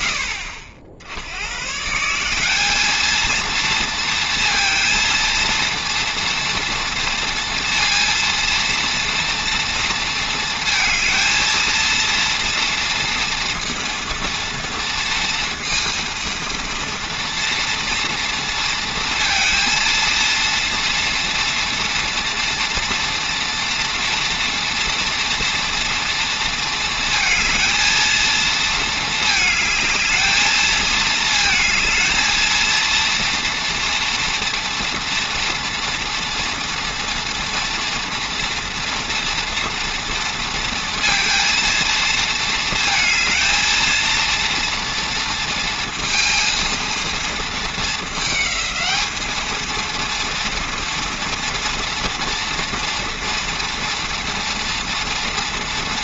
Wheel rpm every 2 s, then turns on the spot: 60, 220, 230, 230, 240, 230, 230, 230, 230, 230, 230, 230, 230, 220, 220, 220, 230, 230, 230, 240, 230, 230, 230, 230, 220, 230, 230, 240.
none